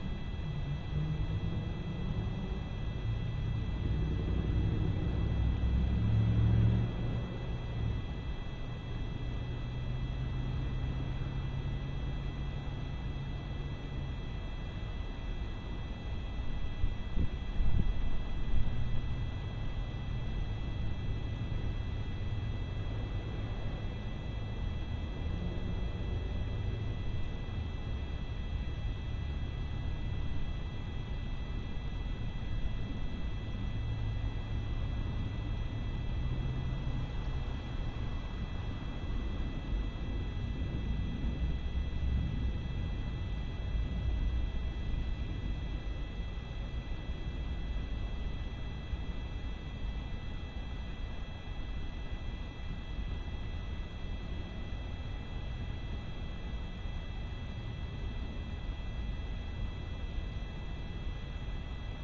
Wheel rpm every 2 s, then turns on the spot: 0, 0, 0, 0, 0, 0, 0, 0, 0, 0, 0, 0, 0, 0, 0, 0, 0, 0, 0, 0, 0, 0, 0, 0, 0, 0, 0, 0, 0, 0, 0.
none